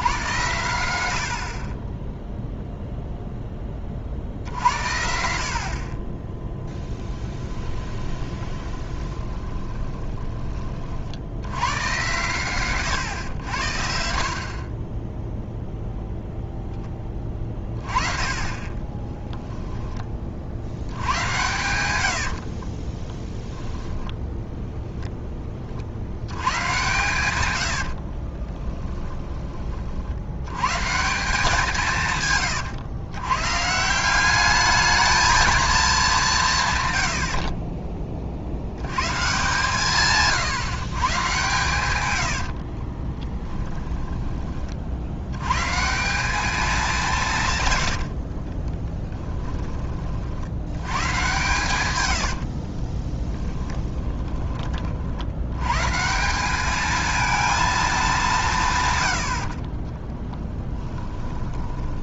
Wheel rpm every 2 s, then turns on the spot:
90, 0, 60, 10, 20, 50, 110, 20, 10, 20, 70, 30, 0, 120, 20, 140, 120, 210, 120, 100, 140, 40, 50, 200, 10, 100, 40, 40, 220, 120, 10.
6-10 18-20 22-24 28-30 42-44 48-50 52-54 60-62